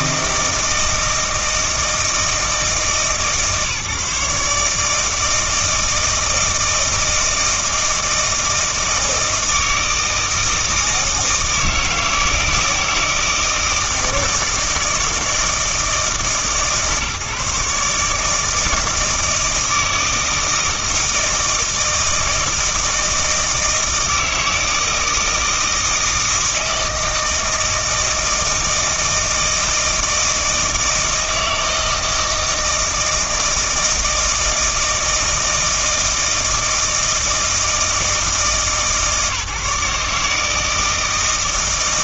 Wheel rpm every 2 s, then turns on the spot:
160, 150, 150, 160, 160, 160, 160, 160, 140, 160, 160, 160, 160, 160, 160, 160, 160, 160, 160, 160, 160.
none